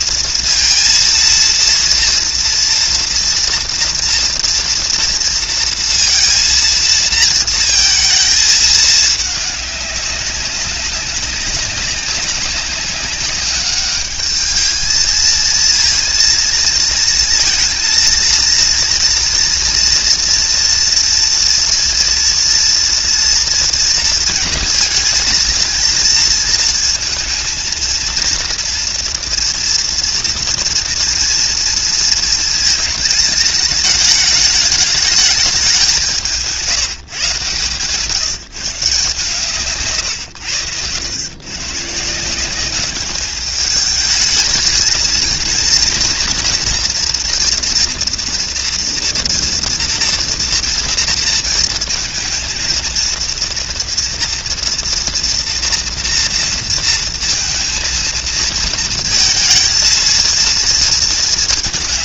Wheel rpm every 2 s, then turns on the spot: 230, 230, 230, 230, 220, 200, 190, 210, 230, 230, 230, 230, 220, 230, 230, 230, 230, 210, 160, 160, 100, 190, 220, 230, 230, 240, 220, 230, 230, 230, 230.
none